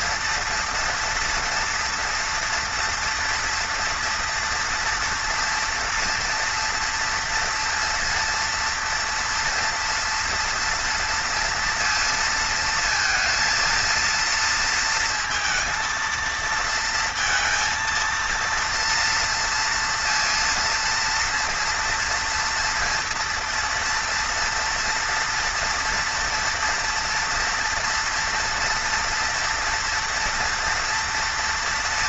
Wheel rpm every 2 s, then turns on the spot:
230, 230, 230, 230, 230, 230, 230, 230, 230, 230, 230, 230, 230, 230, 240, 230.
none